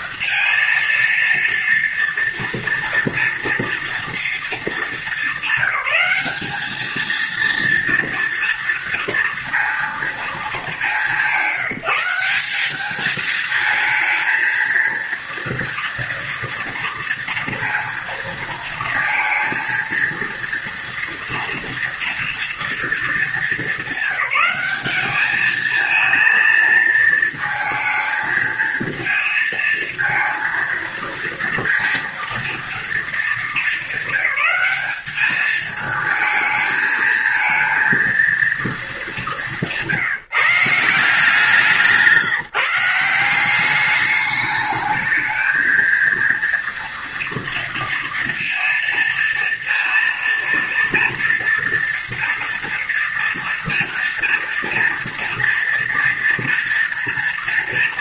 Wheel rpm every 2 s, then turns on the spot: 230, 230, 220, 210, 230, 200, 200, 230, 230, 220, 230, 230, 210, 230, 220, 230, 230, 200, 230, 220, 170, 170, 210, 230, 230, 230, 230, 230, 230.
none